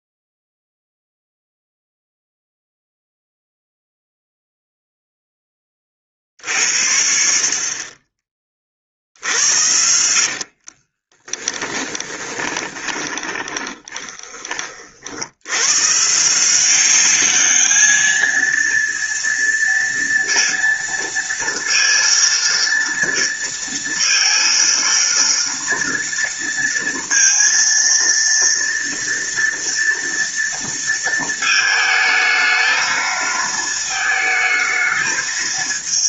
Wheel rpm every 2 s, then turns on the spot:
0, 0, 10, 50, 60, 20, 20, 80, 200, 230, 230, 230, 230, 230, 230, 220, 220, 220.
8-14